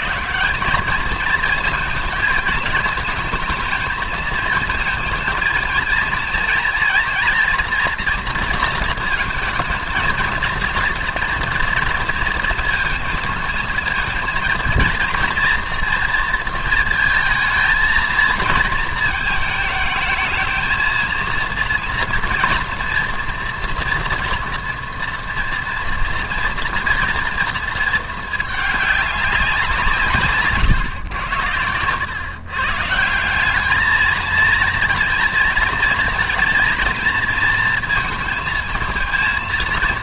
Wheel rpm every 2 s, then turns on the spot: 220, 220, 220, 230, 220, 230, 220, 230, 220, 220, 230, 230, 230, 230, 200, 110, 160, 220, 230, 230.
none